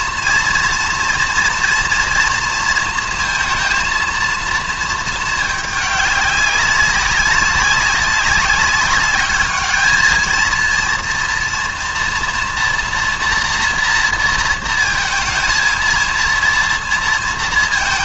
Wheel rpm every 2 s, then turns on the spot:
240, 220, 220, 190, 200, 230, 240, 230, 230.
none